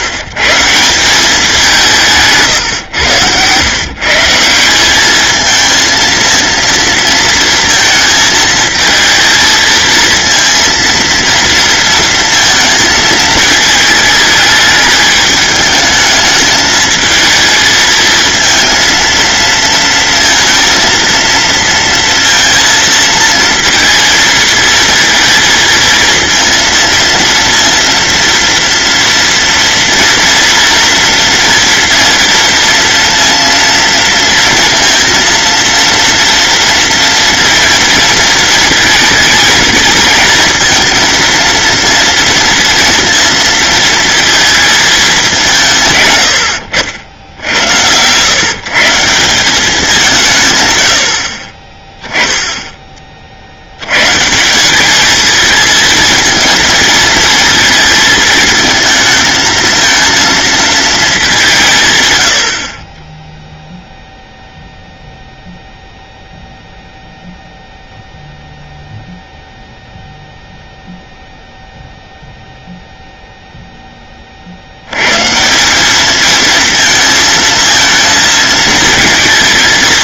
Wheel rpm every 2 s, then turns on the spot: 170, 120, 190, 230, 220, 230, 220, 210, 220, 230, 230, 230, 230, 230, 230, 230, 230, 230, 230, 220, 220, 230, 220, 70, 150, 110, 20, 200, 230, 220, 230, 50, 0, 0, 0, 0, 0, 80, 230, 220.
2-4